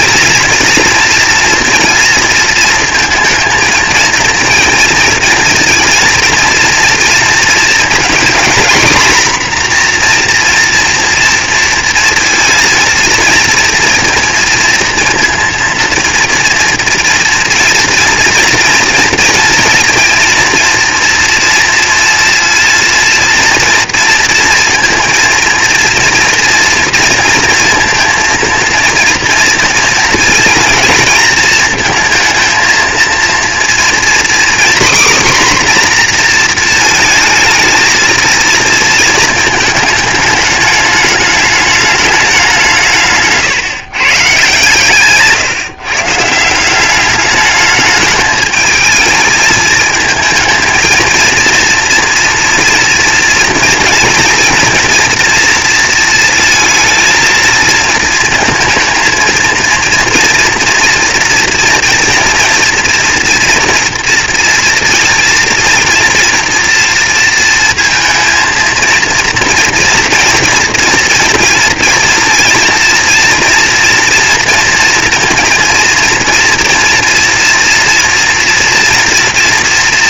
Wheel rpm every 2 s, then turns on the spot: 230, 230, 230, 230, 240, 240, 230, 230, 240, 240, 230, 230, 230, 230, 230, 230, 230, 250, 230, 230, 210, 180, 140, 170, 220, 230, 240, 240, 230, 230, 230, 240, 230, 230, 230, 230, 230, 230, 230, 230.
none